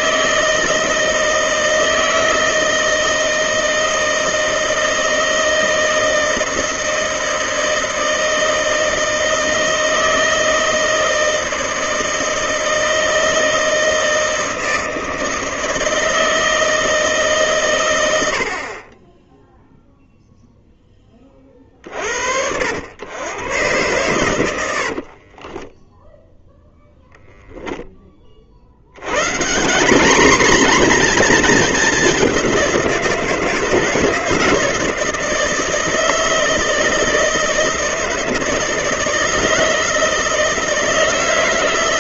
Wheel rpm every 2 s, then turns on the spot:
160, 160, 160, 160, 160, 160, 160, 160, 160, 50, 10, 90, 90, 0, 60, 240, 190, 170, 160, 160, 160.
24-26